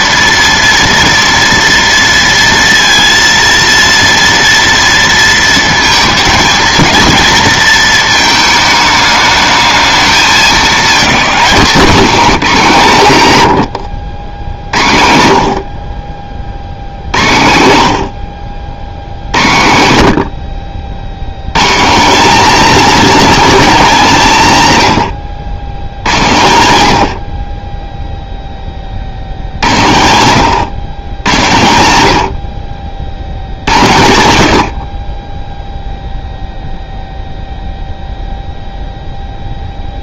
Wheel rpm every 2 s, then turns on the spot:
230, 230, 230, 220, 210, 220, 200, 70, 70, 80, 50, 250, 160, 100, 30, 120, 60, 80, 0, 0.
12-14